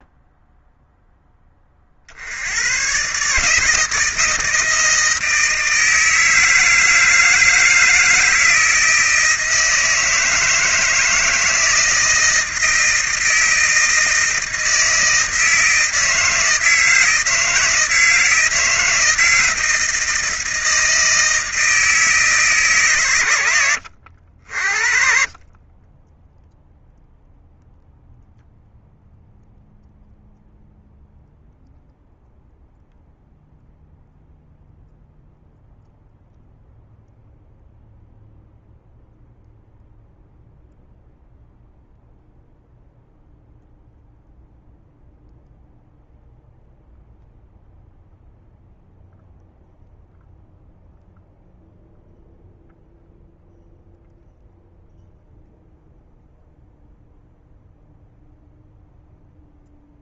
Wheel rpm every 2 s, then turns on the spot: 0, 130, 160, 160, 160, 160, 160, 160, 160, 160, 160, 140, 50, 0, 0, 0, 0, 0, 0, 0, 0, 0, 0, 0, 0, 0, 0, 0, 0, 0.
none